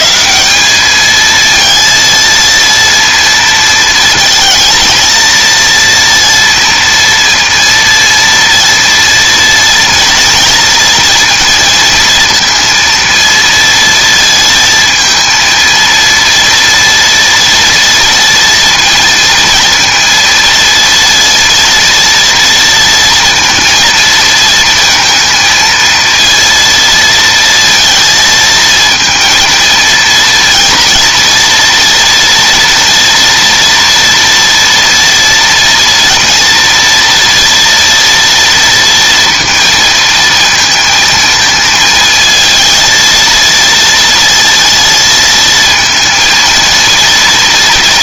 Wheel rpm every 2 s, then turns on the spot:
190, 230, 230, 230, 230, 230, 230, 230, 230, 230, 230, 230, 220, 230, 220, 230, 230, 230, 230, 230, 220, 230, 230, 230.
none